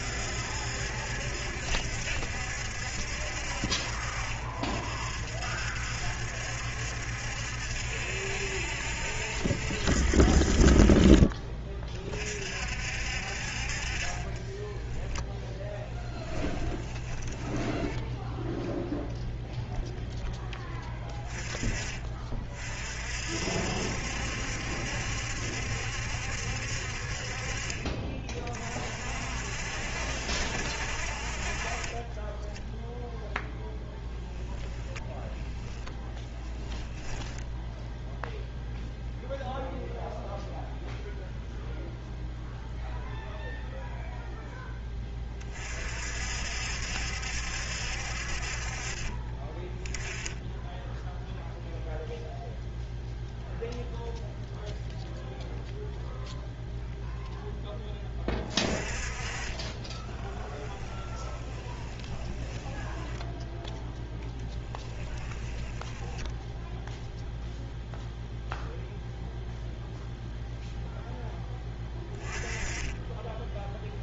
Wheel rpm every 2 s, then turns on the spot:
70, 70, 60, 70, 60, 40, 50, 10, 10, 0, 20, 50, 70, 60, 50, 60, 0, 0, 10, 0, 0, 0, 10, 70, 40, 10, 0, 0, 0, 30, 20, 10, 10, 0, 0, 0, 10.
14-18 36-38 60-66